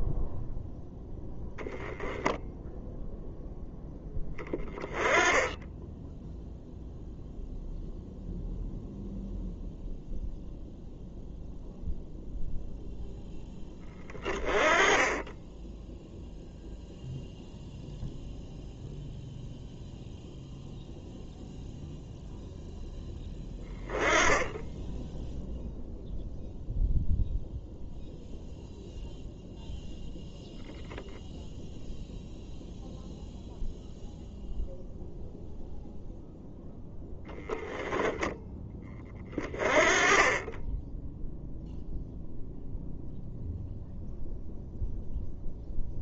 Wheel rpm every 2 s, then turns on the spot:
0, 0, 10, 0, 0, 0, 0, 20, 0, 0, 0, 0, 10, 0, 0, 0, 0, 0, 0, 0, 20, 0, 0.
none